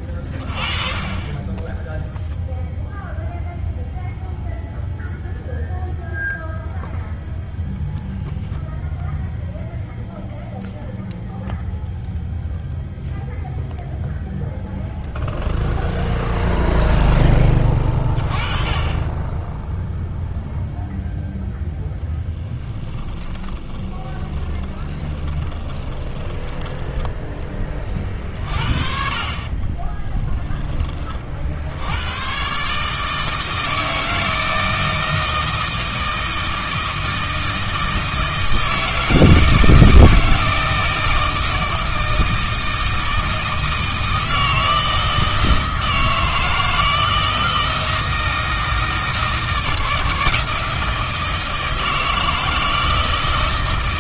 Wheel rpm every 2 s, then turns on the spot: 20, 0, 0, 0, 0, 0, 0, 0, 0, 30, 0, 10, 20, 10, 50, 30, 150, 160, 160, 160, 160, 160, 160, 160, 160, 160, 160.
22-28